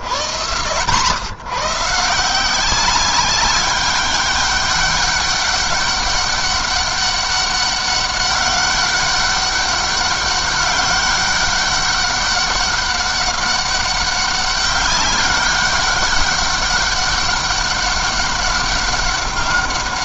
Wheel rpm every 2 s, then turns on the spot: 120, 190, 200, 200, 200, 190, 200, 200, 200, 200.
none